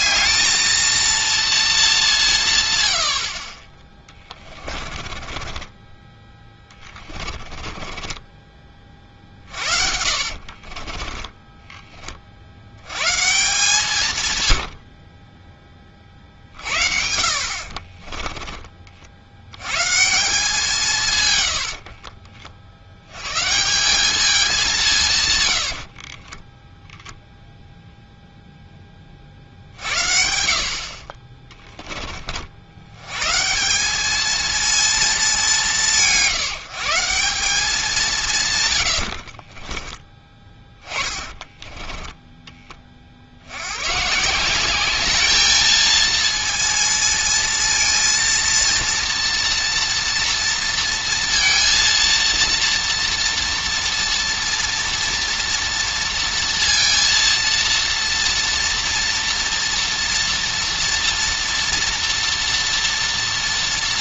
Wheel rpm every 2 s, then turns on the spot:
220, 170, 20, 10, 20, 40, 60, 110, 50, 20, 180, 40, 200, 20, 0, 60, 60, 220, 160, 150, 20, 20, 170, 230, 230, 230, 230, 230, 230, 240, 240, 230.
4-6 10-12 14-16 26-28 40-42